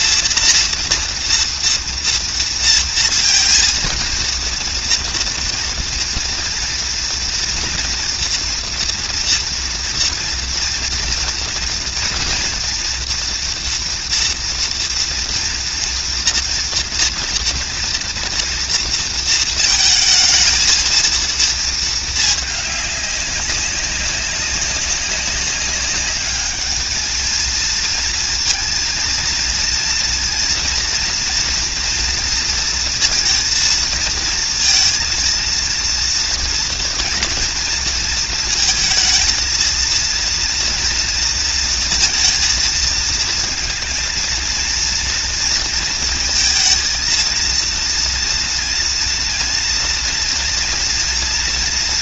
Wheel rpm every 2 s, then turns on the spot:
230, 230, 230, 230, 230, 230, 230, 240, 230, 230, 230, 200, 190, 210, 230, 230, 230, 230, 230, 230, 230, 230, 230, 230, 230, 240.
none